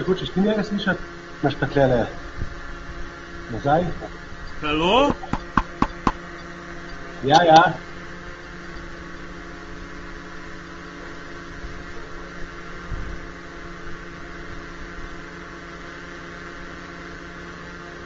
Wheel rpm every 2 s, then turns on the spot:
0, 0, 0, 0, 0, 0, 0, 0, 0.
none